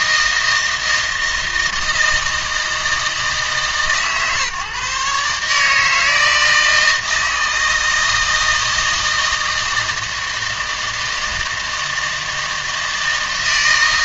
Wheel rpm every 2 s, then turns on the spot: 160, 160, 140, 160, 160, 160, 160.
none